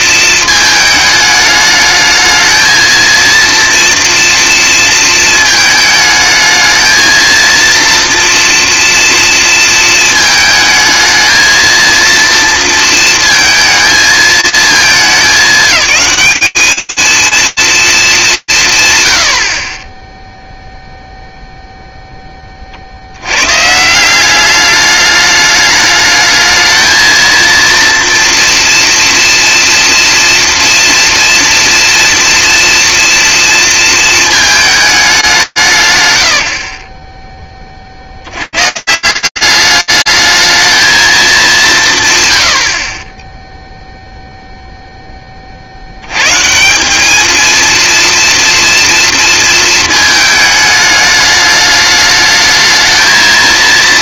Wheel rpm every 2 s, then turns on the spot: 210, 230, 230, 220, 230, 220, 220, 210, 220, 100, 0, 100, 210, 230, 230, 230, 240, 150, 30, 200, 200, 10, 70, 230, 220, 210, 230.
none